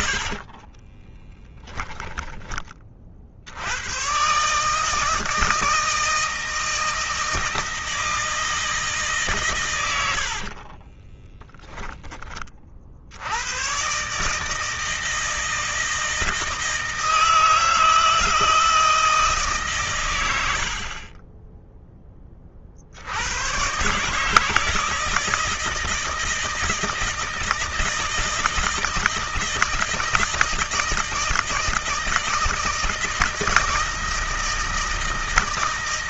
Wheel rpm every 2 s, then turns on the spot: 20, 40, 160, 160, 160, 40, 50, 160, 160, 160, 50, 60, 160, 170, 160, 160, 160, 160.
0-2 10-12